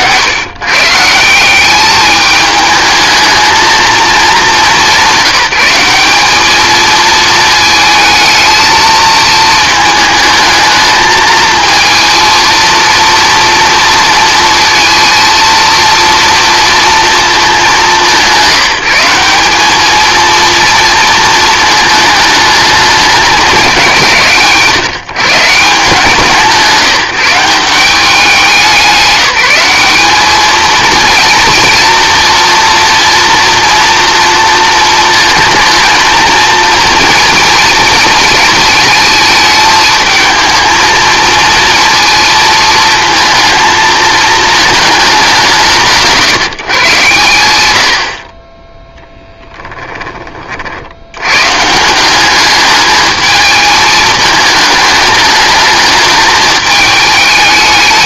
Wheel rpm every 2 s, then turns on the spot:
170, 220, 190, 220, 230, 220, 230, 230, 230, 190, 230, 210, 150, 160, 170, 230, 240, 230, 230, 220, 220, 230, 210, 130, 10, 70, 210, 220, 210.
none